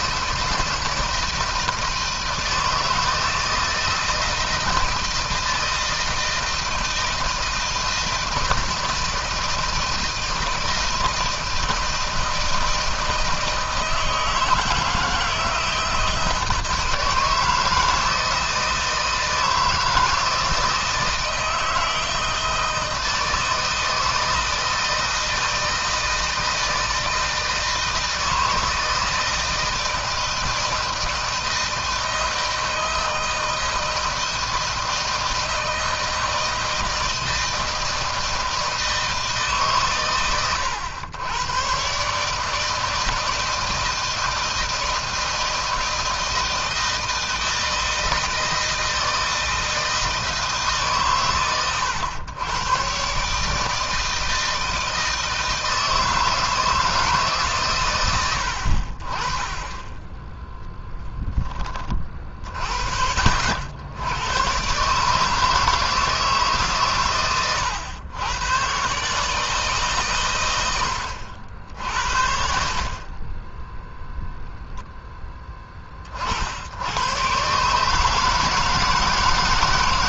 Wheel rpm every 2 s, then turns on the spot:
160, 160, 160, 160, 160, 160, 160, 160, 160, 160, 160, 160, 160, 160, 160, 160, 160, 160, 160, 160, 110, 160, 160, 160, 160, 140, 120, 160, 160, 50, 10, 70, 140, 140, 130, 80, 40, 0, 100, 160.
none